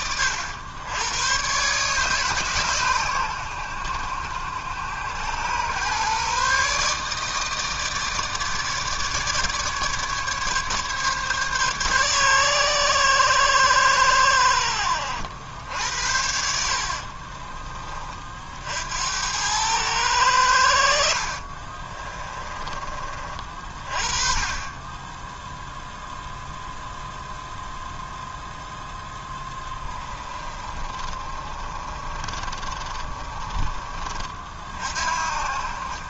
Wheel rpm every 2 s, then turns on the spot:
100, 110, 80, 150, 150, 140, 120, 80, 60, 70, 80, 30, 20, 0, 0, 30, 30, 50.
16-18 30-34